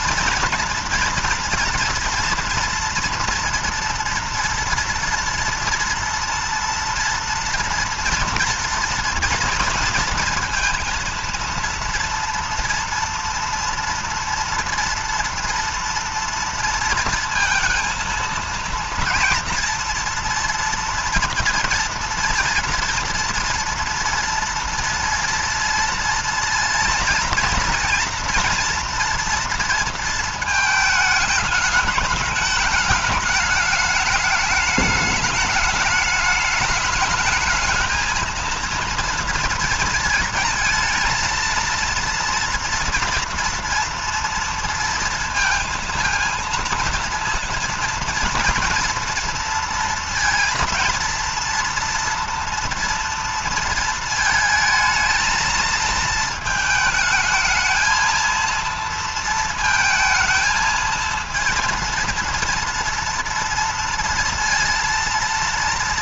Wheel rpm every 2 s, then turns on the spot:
240, 230, 230, 230, 230, 230, 230, 230, 230, 230, 230, 240, 230, 230, 240, 220, 210, 210, 210, 230, 230, 230, 230, 230, 240, 230, 230, 220, 220, 230, 220, 230, 230.
none